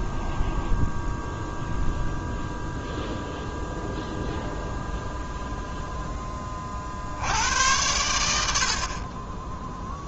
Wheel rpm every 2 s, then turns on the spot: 0, 0, 0, 40, 50.
none